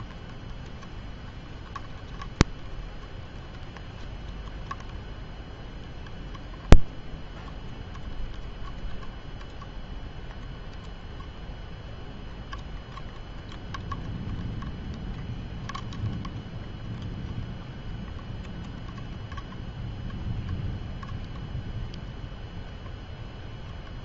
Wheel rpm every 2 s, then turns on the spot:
0, 0, 0, 0, 0, 0, 0, 0, 0, 0, 0, 0.
none